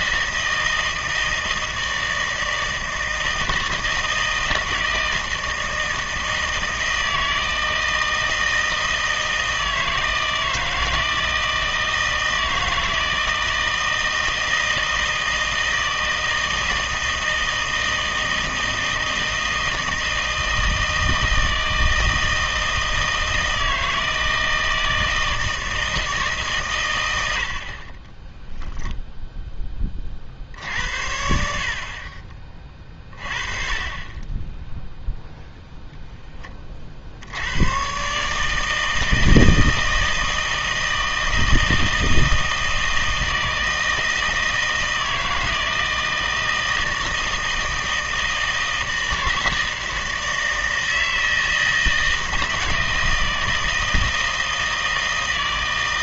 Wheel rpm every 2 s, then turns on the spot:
160, 160, 160, 160, 160, 160, 160, 160, 160, 160, 160, 160, 160, 130, 0, 70, 40, 10, 30, 160, 160, 160, 160, 160, 160, 160, 160, 160.
none